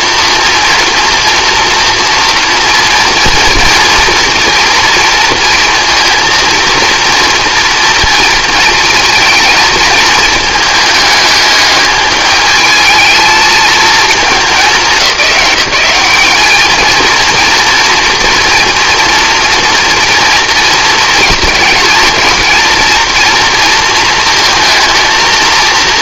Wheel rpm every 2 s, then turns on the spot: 230, 240, 230, 230, 230, 220, 220, 200, 220, 230, 230, 220, 230.
none